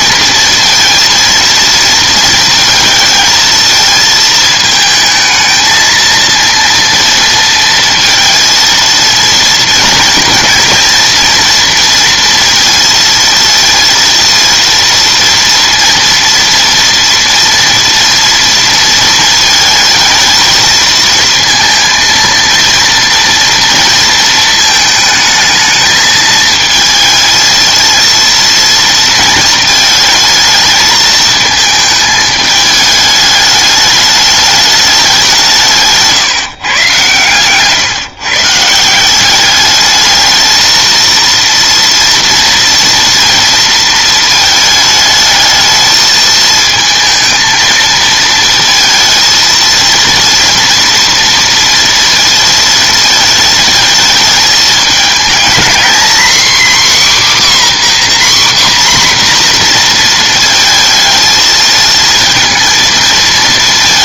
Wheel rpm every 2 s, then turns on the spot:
230, 230, 220, 230, 230, 230, 230, 230, 230, 230, 220, 230, 220, 220, 230, 220, 210, 210, 140, 150, 220, 230, 220, 220, 230, 230, 230, 210, 260, 260, 230, 230.
none